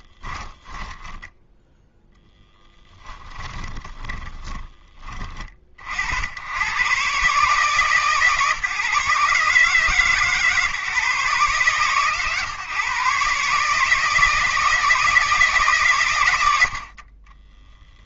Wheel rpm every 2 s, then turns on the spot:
10, 10, 20, 120, 140, 140, 140, 160, 80.
0-4